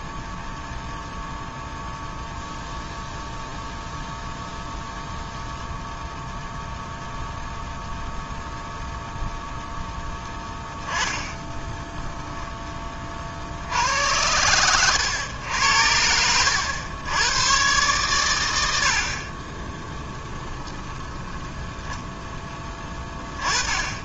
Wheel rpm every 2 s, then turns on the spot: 0, 0, 0, 0, 0, 10, 20, 110, 90, 70, 10, 10.
20-22